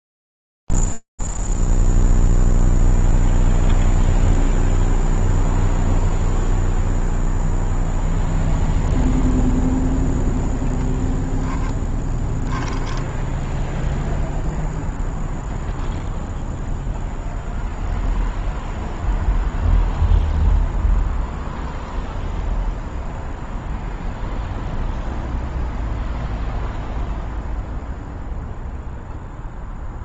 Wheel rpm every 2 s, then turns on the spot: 0, 0, 0, 0, 0, 20, 10, 0, 0, 0, 0, 0, 0, 0, 0.
10-14